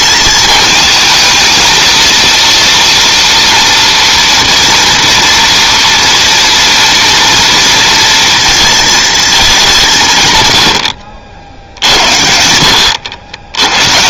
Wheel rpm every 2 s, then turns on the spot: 220, 230, 230, 230, 230, 90, 80.
none